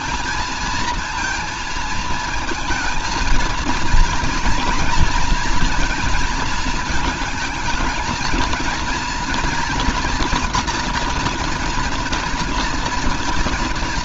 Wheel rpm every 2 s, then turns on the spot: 230, 220, 230, 220, 230, 230, 230.
none